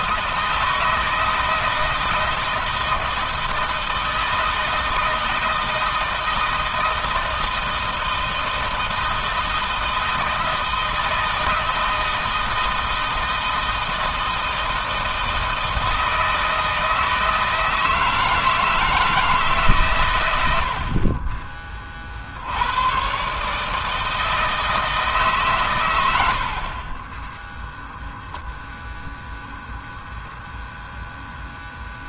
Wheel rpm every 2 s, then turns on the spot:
160, 160, 160, 160, 160, 160, 160, 160, 160, 160, 50, 110, 150, 20, 0, 10.
26-28